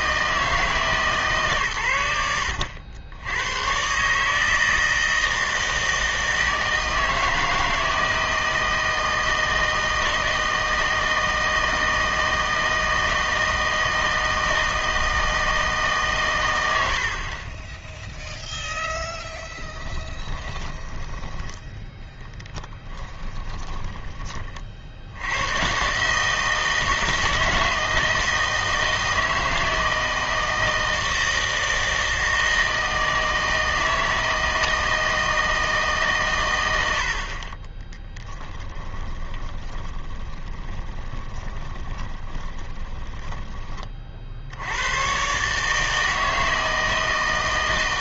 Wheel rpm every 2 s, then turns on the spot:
160, 80, 160, 160, 160, 160, 160, 160, 100, 0, 20, 10, 40, 160, 160, 160, 160, 160, 100, 10, 20, 20, 80, 160.
20-24 38-44